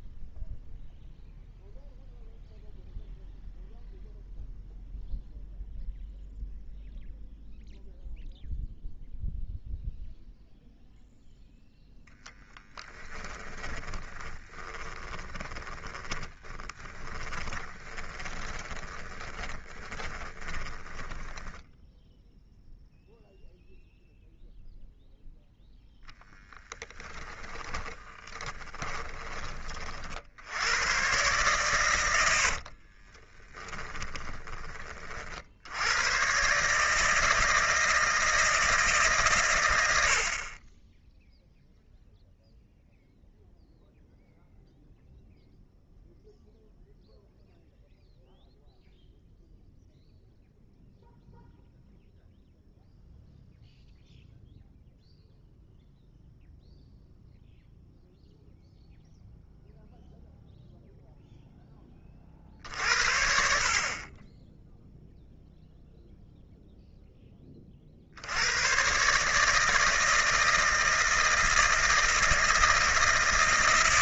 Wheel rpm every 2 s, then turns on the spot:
0, 0, 0, 0, 0, 0, 10, 30, 10, 20, 10, 0, 0, 10, 20, 100, 60, 30, 150, 160, 20, 0, 0, 0, 0, 0, 0, 0, 0, 0, 0, 50, 0, 0, 110, 160, 160.
12-22 26-30 32-34